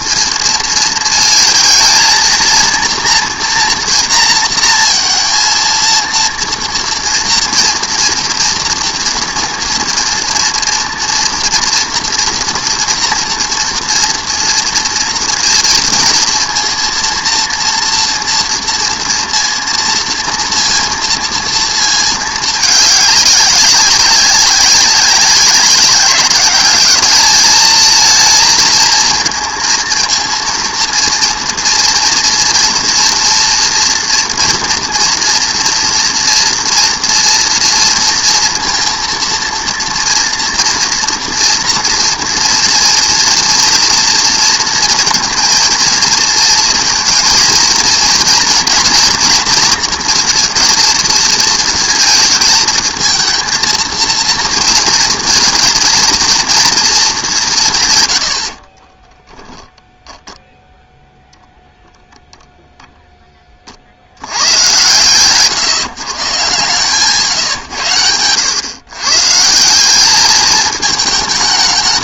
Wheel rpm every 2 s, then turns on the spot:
230, 230, 230, 230, 230, 230, 230, 230, 230, 230, 230, 210, 200, 200, 230, 230, 230, 230, 230, 230, 230, 230, 230, 230, 230, 230, 220, 230, 230, 50, 0, 0, 100, 140, 110, 210.
58-60